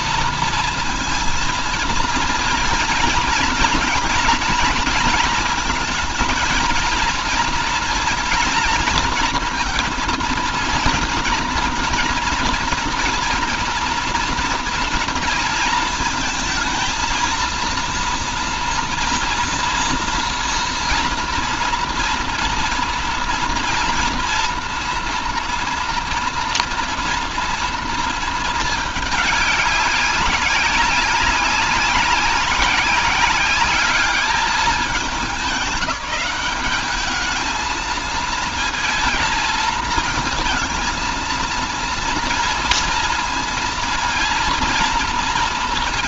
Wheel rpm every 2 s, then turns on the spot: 230, 230, 230, 230, 230, 230, 230, 230, 220, 240, 230, 230, 240, 230, 220, 200, 190, 200, 200, 220, 220, 230, 230.
none